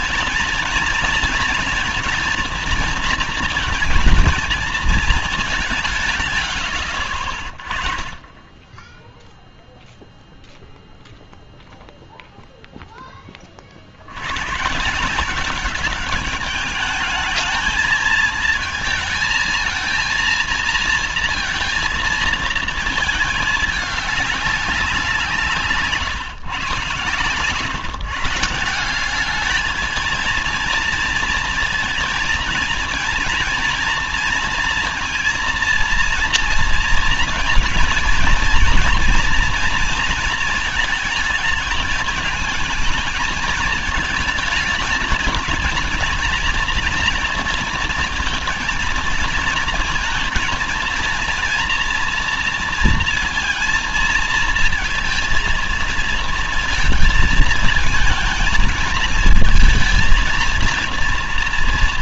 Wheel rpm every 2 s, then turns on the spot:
230, 230, 230, 100, 10, 0, 0, 140, 210, 220, 230, 220, 190, 140, 170, 230, 230, 230, 230, 230, 230, 220, 210, 230, 230, 230, 230, 220, 230, 220, 230.
none